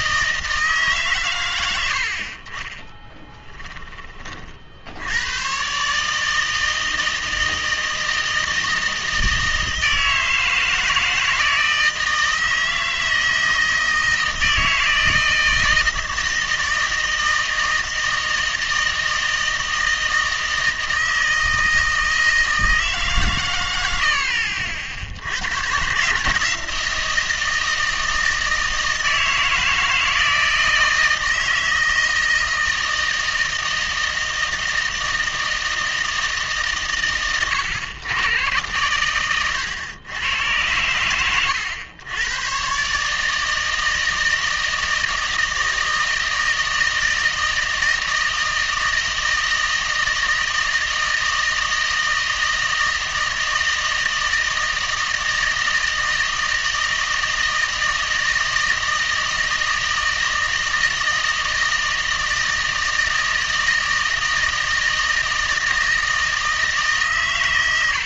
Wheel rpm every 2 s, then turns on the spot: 140, 30, 70, 160, 160, 160, 160, 160, 160, 160, 160, 160, 70, 160, 160, 160, 160, 160, 120, 110, 100, 140, 160, 160, 160, 160, 160, 160, 160, 160, 160, 160, 160, 150.
none